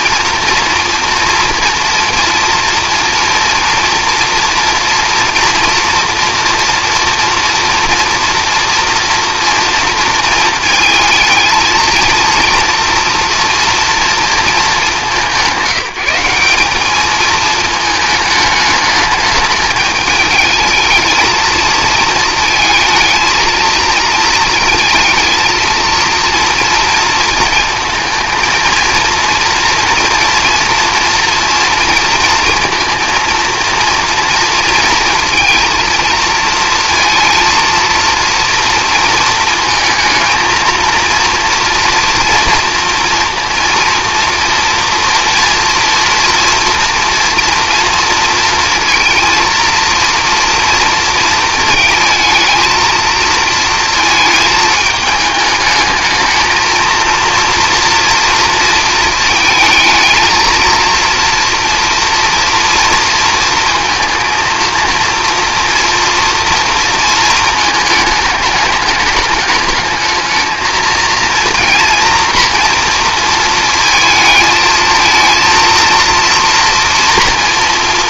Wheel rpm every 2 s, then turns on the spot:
230, 230, 230, 240, 230, 220, 230, 210, 200, 210, 220, 220, 230, 230, 230, 240, 230, 230, 230, 230, 230, 230, 230, 230, 230, 230, 230, 220, 230, 230, 230, 230, 230, 230, 210, 230, 240, 220, 230.
none